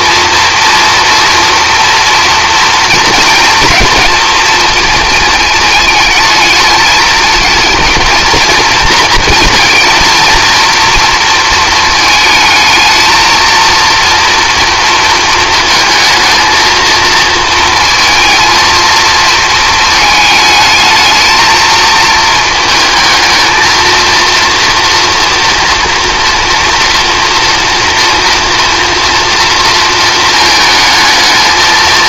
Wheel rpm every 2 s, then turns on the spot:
230, 230, 230, 220, 230, 230, 220, 230, 230, 220, 220, 220, 230, 230, 230, 220.
none